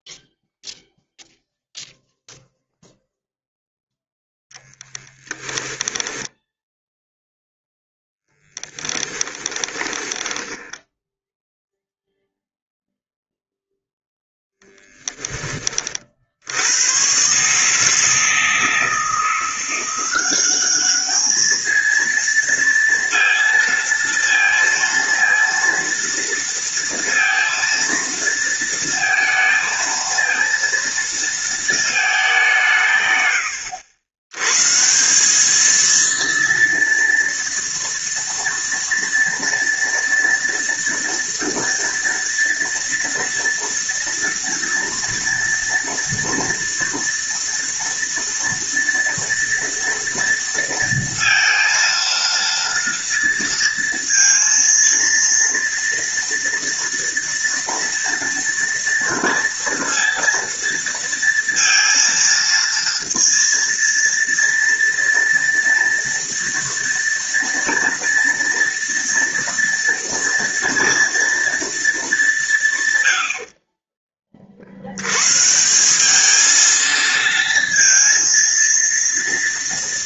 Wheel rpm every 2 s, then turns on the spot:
0, 0, 10, 0, 10, 10, 0, 0, 100, 160, 210, 230, 230, 230, 230, 230, 140, 160, 230, 230, 230, 230, 230, 230, 230, 230, 230, 230, 230, 230, 230, 230, 230, 230, 230, 230, 130, 90, 230, 230.
4-6 8-10